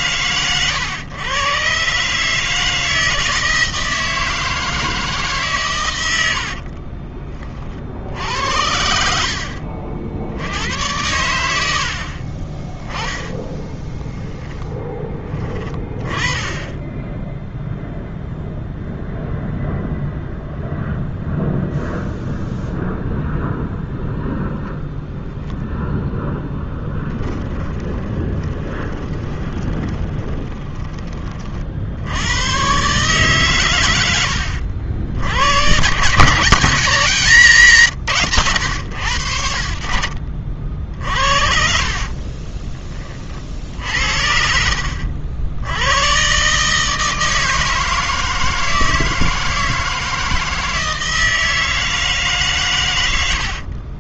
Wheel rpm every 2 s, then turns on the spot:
120, 160, 160, 40, 70, 100, 20, 10, 10, 0, 0, 0, 0, 10, 20, 20, 130, 80, 190, 100, 60, 30, 70, 150, 160, 160, 110.
6-10 12-14 26-30